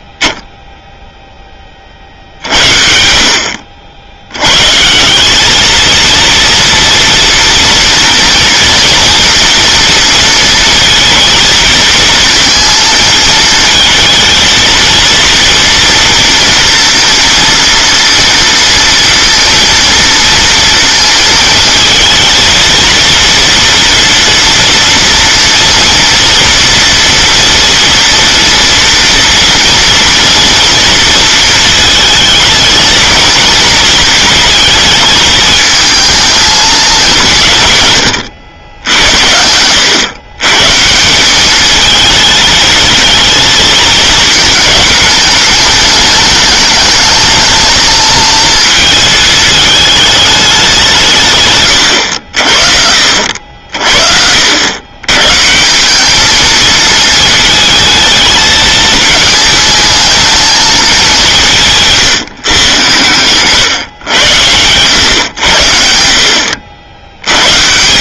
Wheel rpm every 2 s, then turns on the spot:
10, 60, 130, 230, 230, 230, 230, 230, 230, 230, 230, 230, 230, 230, 230, 230, 230, 220, 220, 90, 150, 220, 220, 220, 220, 200, 60, 110, 220, 220, 210, 110, 100, 80.
none